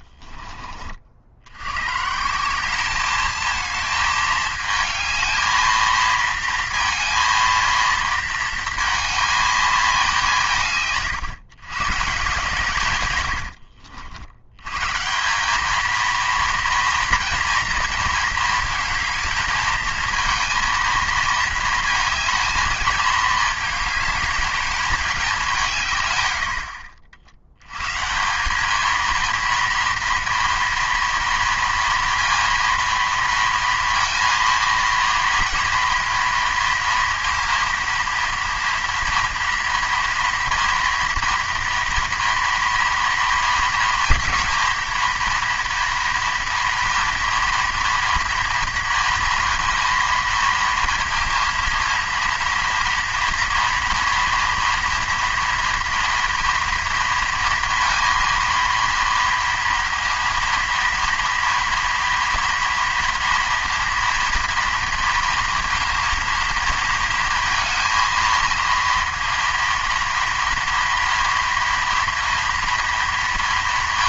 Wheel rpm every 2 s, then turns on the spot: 40, 200, 220, 230, 230, 150, 140, 110, 230, 220, 230, 220, 210, 60, 200, 230, 230, 230, 230, 230, 230, 230, 230, 230, 230, 230, 230, 230, 230, 230, 230, 240, 230, 230, 230, 230, 230.
none